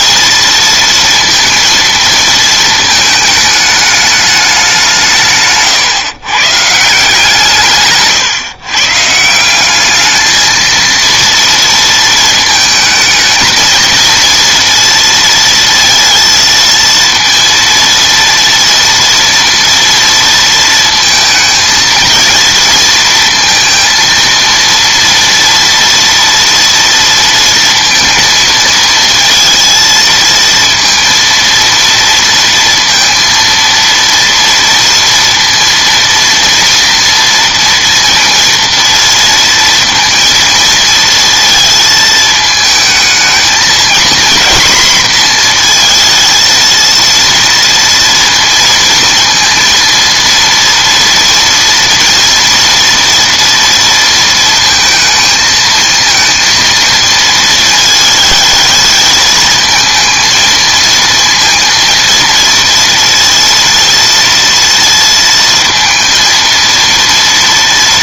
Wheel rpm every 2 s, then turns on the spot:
230, 220, 160, 150, 160, 230, 220, 230, 230, 230, 220, 230, 230, 230, 230, 230, 230, 230, 230, 230, 230, 220, 240, 230, 230, 230, 230, 230, 230, 220, 230, 230, 230, 230.
none